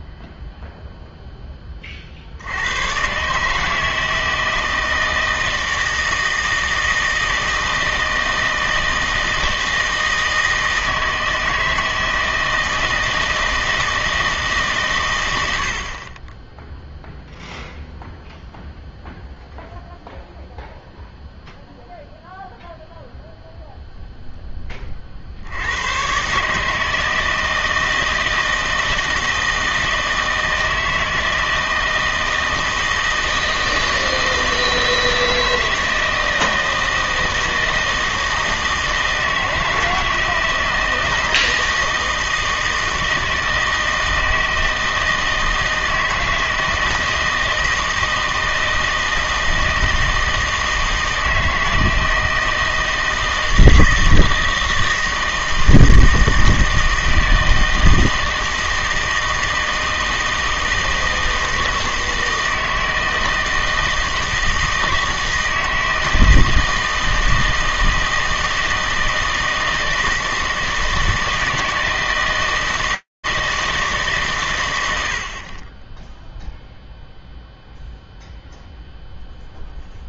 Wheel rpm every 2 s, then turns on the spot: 0, 90, 160, 160, 160, 160, 160, 140, 10, 0, 0, 0, 10, 150, 160, 160, 160, 160, 160, 160, 160, 160, 160, 160, 160, 160, 160, 160, 160, 160, 160, 160, 160, 160, 160, 160, 160, 150, 0, 0.
none